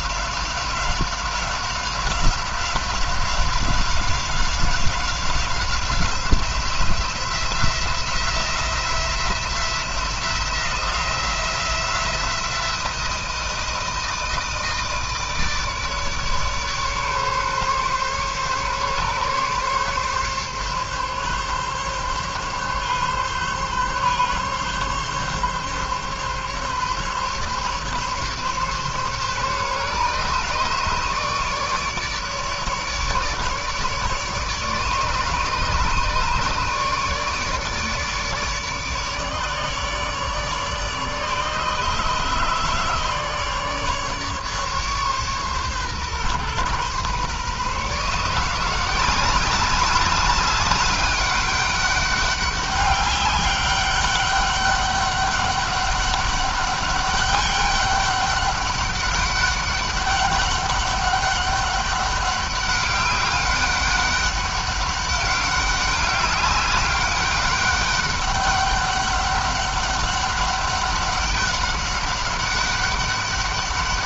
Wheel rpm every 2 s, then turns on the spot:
190, 190, 190, 170, 170, 170, 170, 160, 150, 140, 140, 140, 140, 140, 140, 150, 150, 150, 150, 150, 150, 150, 140, 130, 180, 200, 200, 200, 200, 200, 200, 200, 200, 200, 200, 200, 200.
none